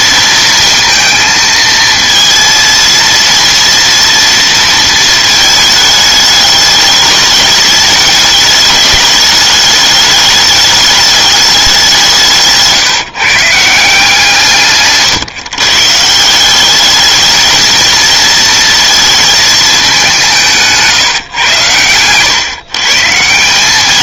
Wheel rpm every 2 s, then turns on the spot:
230, 230, 230, 210, 210, 210, 160, 150, 190, 230, 170, 130.
none